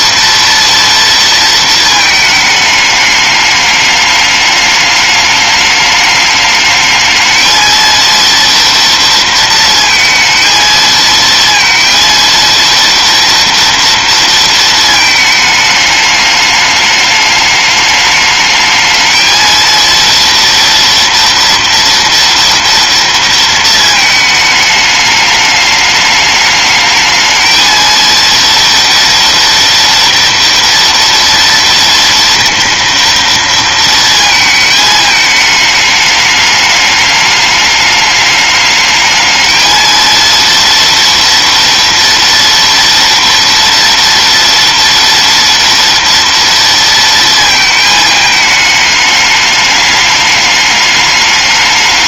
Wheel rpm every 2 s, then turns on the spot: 230, 210, 210, 220, 230, 230, 230, 220, 210, 220, 230, 230, 210, 220, 230, 230, 230, 220, 210, 220, 230, 230, 230, 230, 210, 210.
none